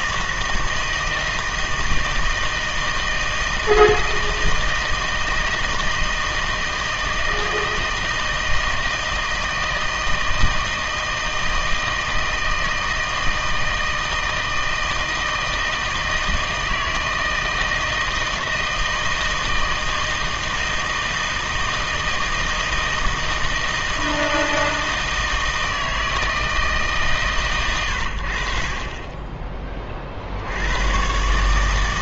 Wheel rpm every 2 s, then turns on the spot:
160, 160, 160, 160, 160, 160, 160, 160, 160, 160, 160, 160, 160, 160, 50, 90.
none